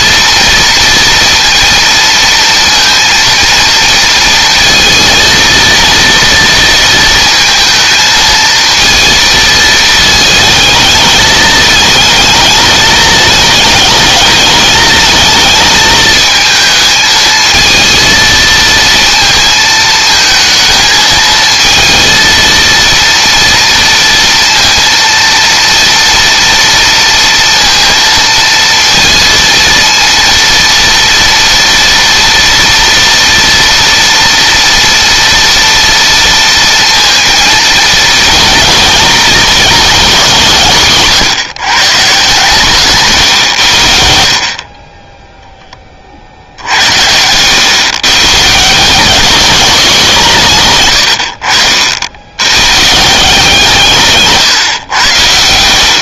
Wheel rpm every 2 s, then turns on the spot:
230, 230, 230, 230, 220, 220, 220, 210, 220, 230, 220, 230, 230, 230, 230, 230, 230, 230, 230, 220, 150, 150, 20, 80, 170, 130, 140, 120.
42-44